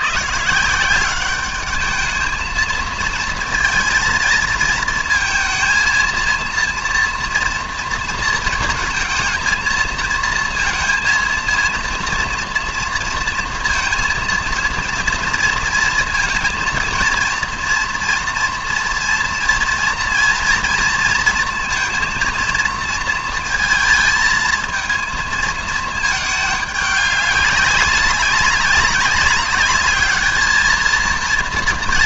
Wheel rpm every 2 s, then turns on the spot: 170, 220, 230, 230, 220, 230, 230, 230, 230, 230, 230, 230, 220, 200, 190, 220.
none